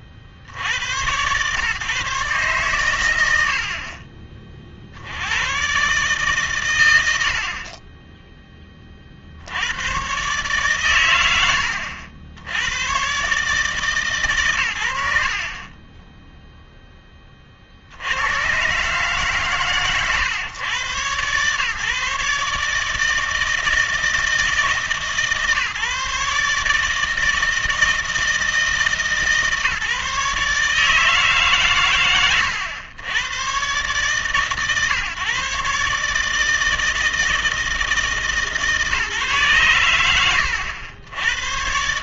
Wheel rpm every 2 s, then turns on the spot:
80, 120, 50, 120, 20, 130, 90, 80, 0, 120, 120, 150, 150, 150, 160, 150, 110, 140, 160, 150, 100.
none